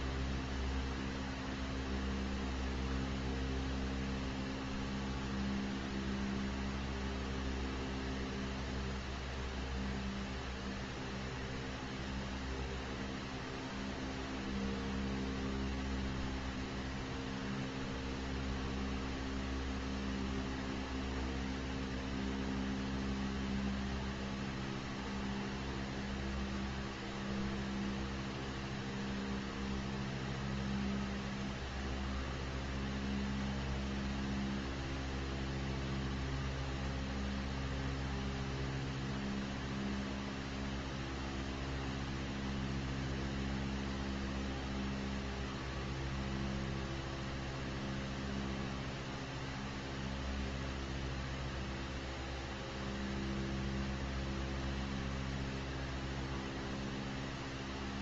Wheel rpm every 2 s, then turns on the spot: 0, 0, 0, 0, 0, 0, 0, 0, 0, 0, 0, 0, 0, 0, 0, 0, 0, 0, 0, 0, 0, 0, 0, 0, 0, 0, 0, 0, 0.
none